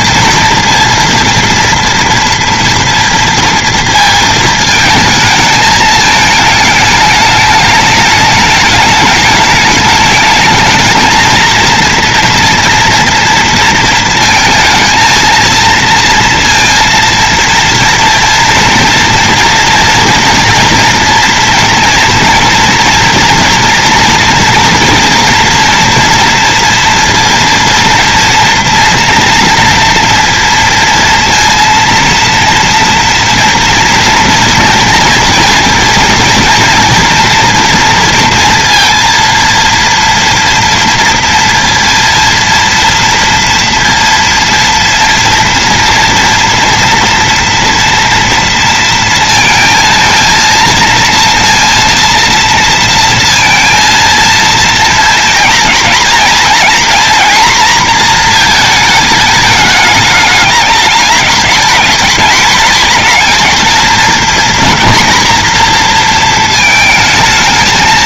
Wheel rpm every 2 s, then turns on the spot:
230, 230, 230, 210, 210, 220, 230, 230, 230, 230, 240, 230, 230, 230, 230, 230, 230, 230, 230, 230, 230, 230, 230, 230, 230, 230, 230, 230, 240, 220, 210, 220, 240, 230.
none